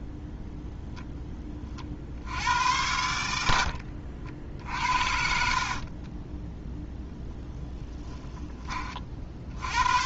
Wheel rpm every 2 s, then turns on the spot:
0, 90, 50, 0, 30.
4-6